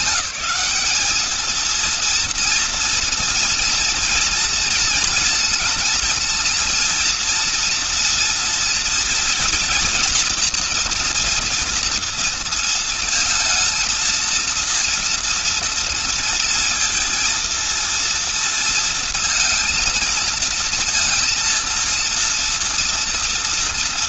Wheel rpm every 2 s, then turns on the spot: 210, 230, 230, 230, 230, 230, 230, 230, 230, 230, 230, 230.
none